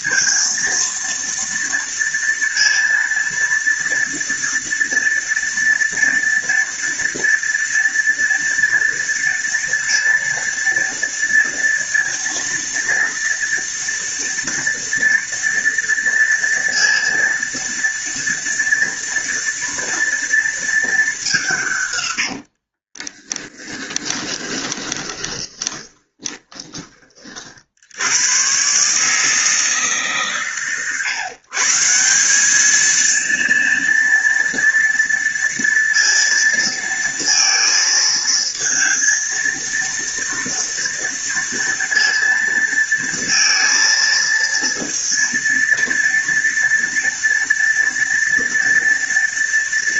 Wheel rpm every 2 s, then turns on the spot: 230, 230, 230, 230, 230, 230, 230, 230, 230, 230, 220, 60, 20, 20, 130, 120, 210, 230, 230, 230, 230, 230, 230, 230, 230.
22-28